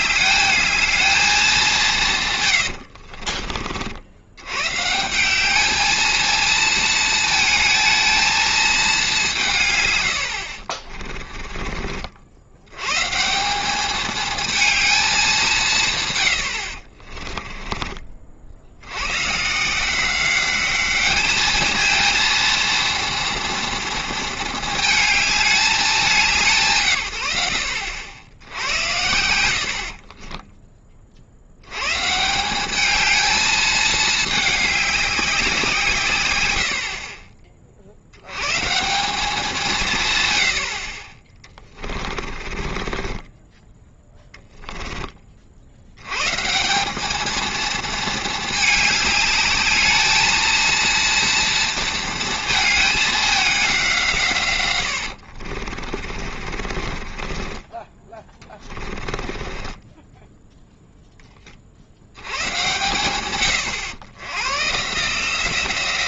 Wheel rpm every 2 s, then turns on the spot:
210, 100, 120, 220, 220, 50, 100, 220, 70, 70, 200, 230, 220, 150, 80, 20, 190, 210, 80, 140, 80, 20, 10, 170, 220, 230, 220, 110, 40, 20, 0, 120, 130.
2-4 10-12 42-46 56-60